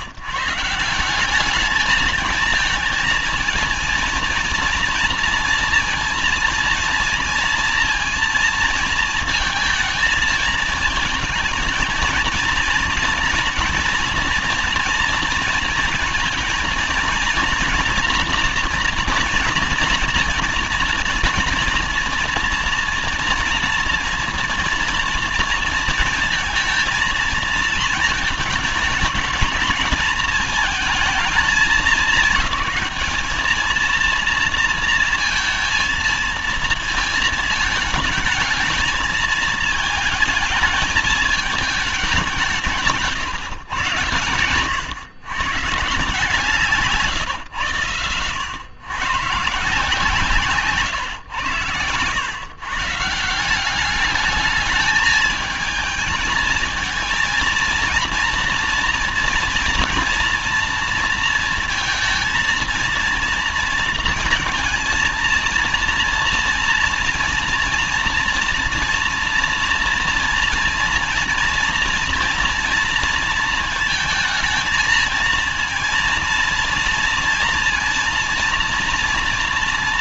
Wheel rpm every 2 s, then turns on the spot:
180, 220, 230, 230, 230, 220, 230, 230, 230, 230, 230, 230, 240, 230, 210, 220, 220, 230, 220, 220, 220, 160, 120, 150, 120, 130, 160, 210, 230, 240, 230, 230, 230, 230, 240, 230, 230, 220, 230, 230.
none